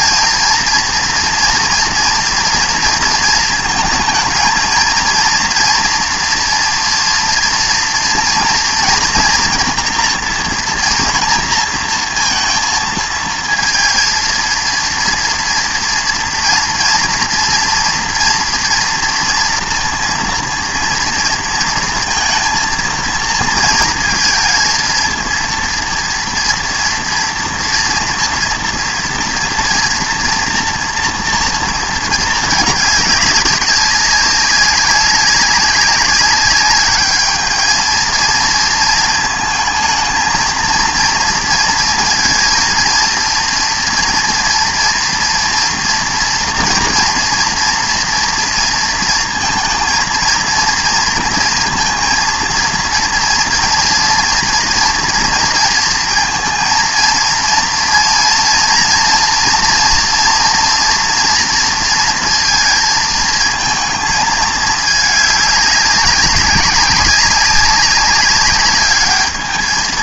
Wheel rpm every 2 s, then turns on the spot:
230, 230, 220, 230, 230, 230, 230, 230, 240, 230, 230, 230, 220, 230, 230, 230, 210, 200, 200, 230, 230, 230, 230, 230, 240, 230, 230, 240, 230, 230, 240, 230, 220, 200, 210.
none